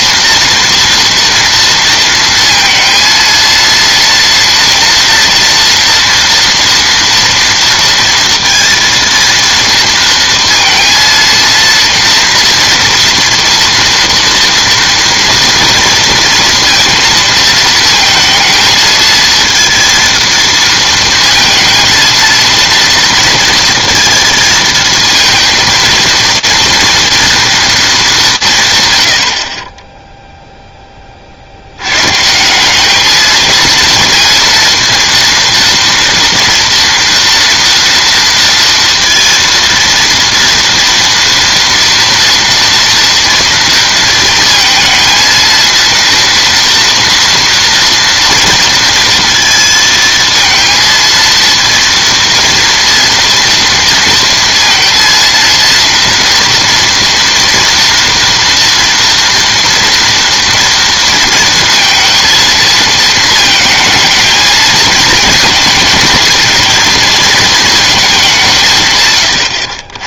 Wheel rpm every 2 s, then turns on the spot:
230, 230, 230, 230, 230, 230, 240, 240, 230, 230, 230, 230, 230, 230, 140, 10, 190, 230, 230, 230, 230, 230, 230, 230, 230, 230, 230, 230, 230, 230, 230, 230, 230, 220, 150.
none